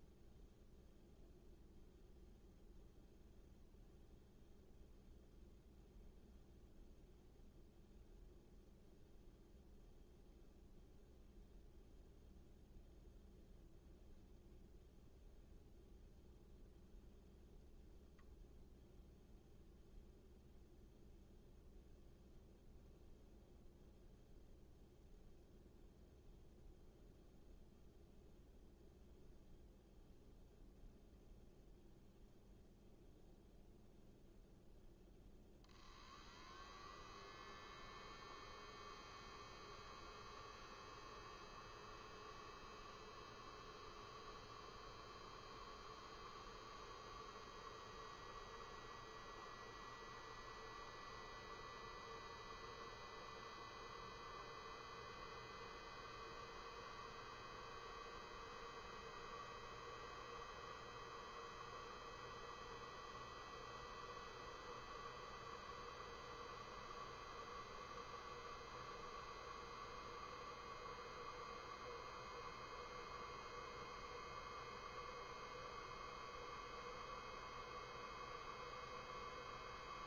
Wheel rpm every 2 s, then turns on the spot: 0, 0, 0, 0, 0, 0, 0, 0, 0, 0, 0, 0, 0, 0, 0, 0, 0, 0, 0, 0, 0, 0, 0, 0, 0, 0, 0, 0, 0, 0, 0, 0, 0, 0, 0, 0, 0, 0, 0, 0.
none